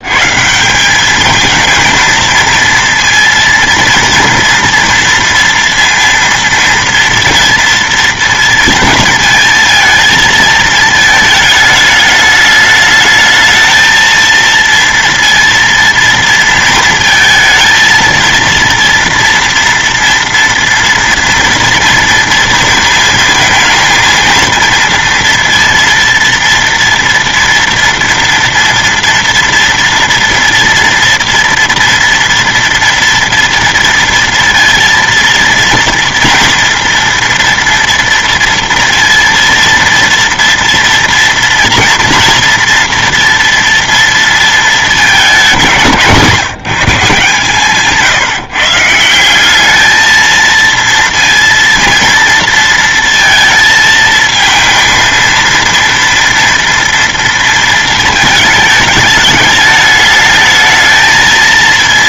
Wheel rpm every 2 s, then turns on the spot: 190, 230, 230, 230, 230, 220, 210, 230, 230, 230, 230, 220, 230, 230, 230, 230, 230, 230, 230, 230, 230, 230, 220, 170, 160, 230, 230, 230, 230, 210, 220.
none